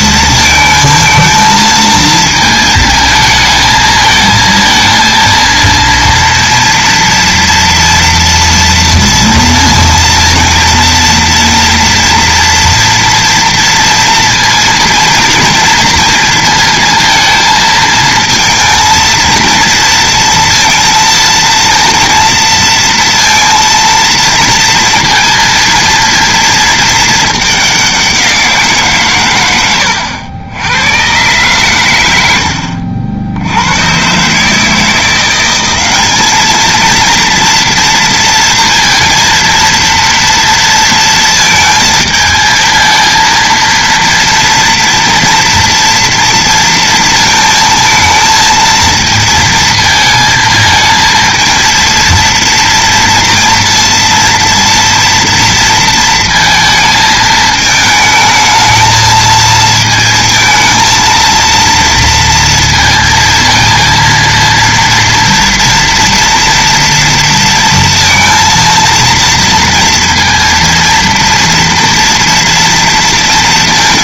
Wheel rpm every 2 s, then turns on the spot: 230, 230, 220, 230, 230, 230, 230, 230, 230, 230, 230, 230, 220, 220, 170, 100, 80, 160, 220, 230, 230, 230, 230, 230, 220, 220, 240, 230, 220, 220, 230, 230, 230, 230, 230, 230, 230.
none